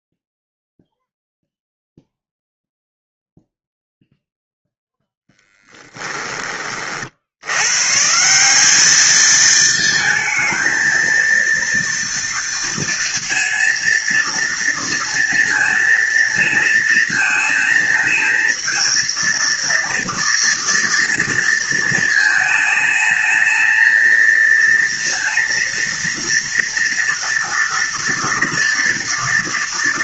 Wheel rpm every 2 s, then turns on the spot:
0, 0, 0, 50, 210, 230, 230, 230, 230, 230, 230, 220, 230, 230, 230.
none